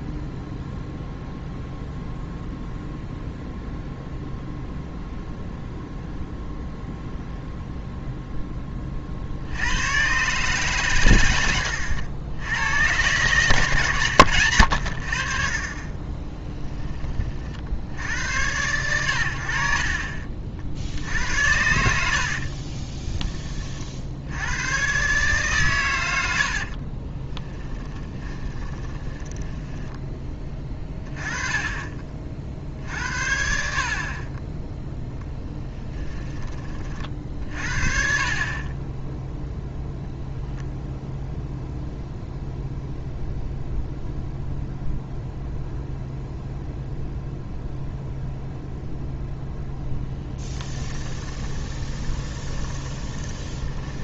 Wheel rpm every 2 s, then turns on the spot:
0, 0, 0, 0, 30, 130, 90, 70, 10, 90, 60, 30, 120, 40, 20, 20, 50, 10, 20, 20, 0, 0, 0, 0, 0, 10, 20.
22-24 26-30 50-54